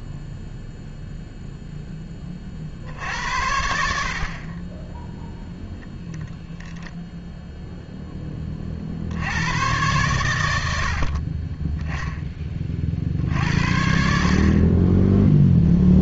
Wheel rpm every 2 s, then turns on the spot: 0, 80, 20, 0, 30, 90, 40, 30.
none